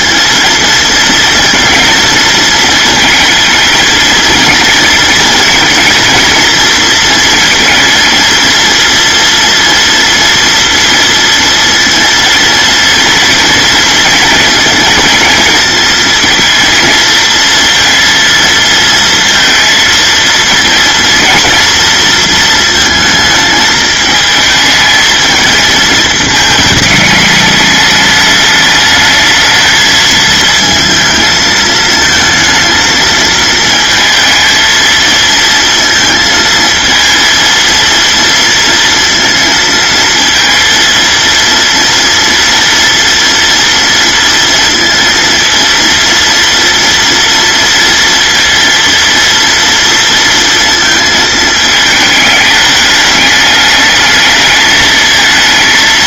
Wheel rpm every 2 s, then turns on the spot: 230, 220, 230, 230, 230, 230, 230, 230, 230, 230, 240, 220, 220, 210, 210, 220, 230, 220, 230, 230, 230, 230, 230, 230, 230, 220, 210, 220.
none